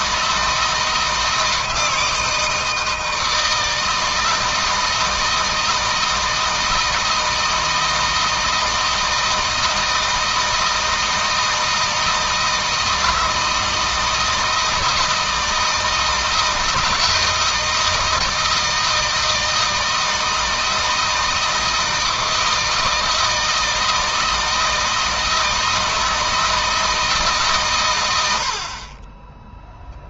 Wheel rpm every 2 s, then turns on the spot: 160, 160, 160, 160, 160, 160, 160, 160, 160, 160, 160, 160, 160, 160, 60.
none